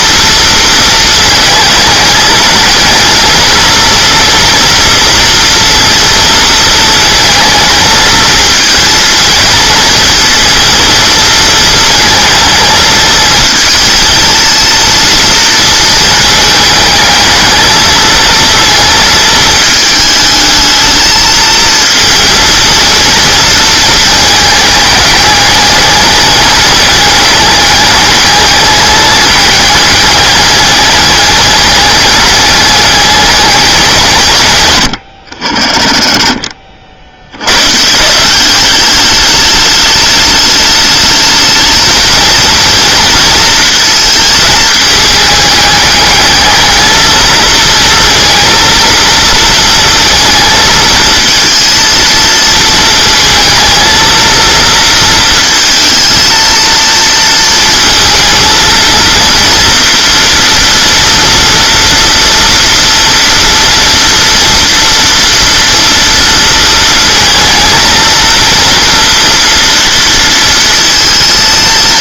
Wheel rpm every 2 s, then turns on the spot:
220, 220, 230, 220, 220, 220, 220, 230, 220, 230, 220, 230, 220, 210, 210, 200, 210, 130, 60, 200, 210, 230, 220, 220, 230, 220, 230, 230, 230, 230, 230, 230, 230, 230, 230, 230.
36-38